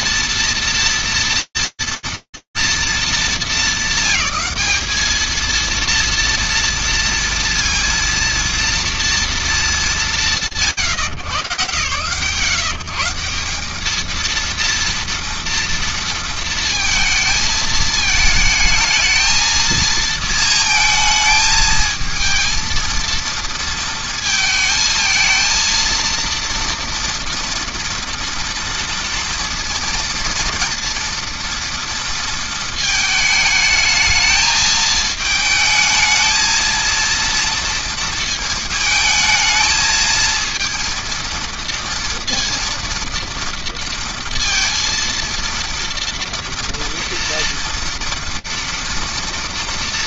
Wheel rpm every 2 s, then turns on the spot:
230, 210, 220, 230, 200, 130, 180, 230, 220, 220, 220, 230, 230, 230, 230, 230, 220, 220, 230, 220, 230, 230, 230, 230, 180.
none